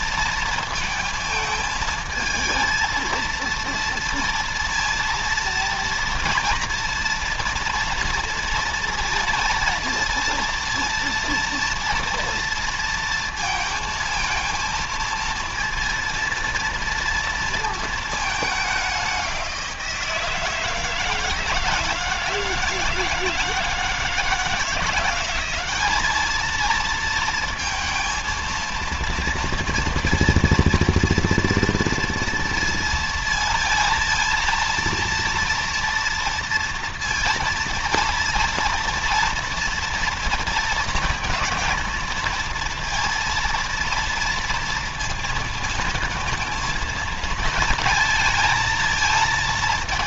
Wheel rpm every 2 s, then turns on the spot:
230, 230, 230, 230, 230, 230, 230, 230, 230, 210, 160, 160, 170, 220, 230, 230, 230, 230, 230, 230, 230, 230, 230, 230, 230.
none